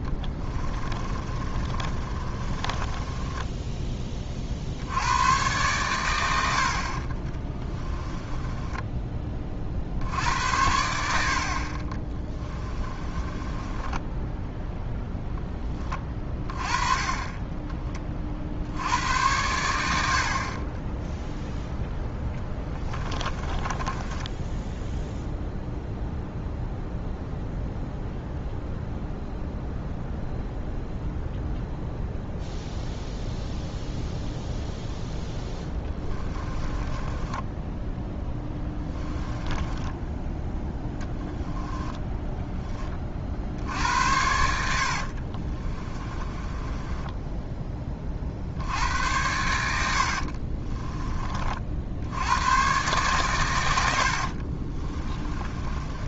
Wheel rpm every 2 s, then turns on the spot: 20, 20, 60, 50, 20, 80, 20, 0, 30, 60, 30, 20, 10, 0, 0, 0, 0, 0, 20, 10, 10, 20, 70, 20, 80, 40, 120, 40.
0-4 6-10 12-14 22-26 36-40 44-48 50-52 54-56